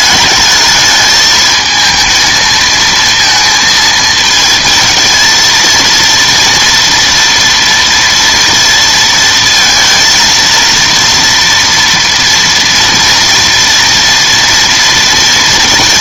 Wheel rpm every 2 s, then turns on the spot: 210, 230, 220, 230, 230, 230, 230, 230.
none